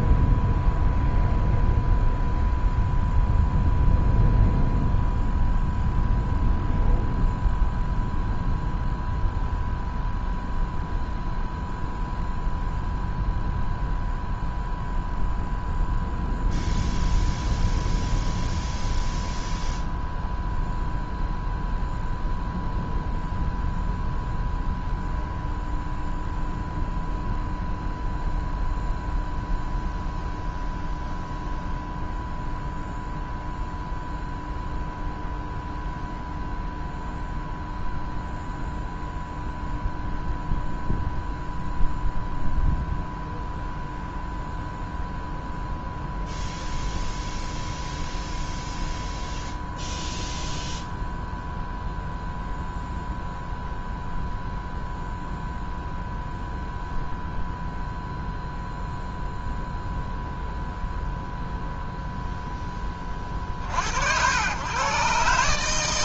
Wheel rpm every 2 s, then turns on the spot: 0, 0, 0, 0, 0, 0, 0, 0, 0, 0, 0, 0, 0, 0, 0, 0, 0, 0, 0, 0, 0, 0, 0, 0, 0, 0, 0, 0, 0, 0, 0, 30, 130.
none